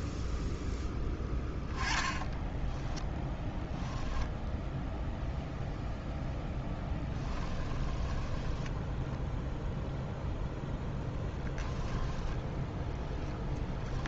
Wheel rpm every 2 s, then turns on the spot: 0, 0, 0, 10, 10, 0, 10.
6-10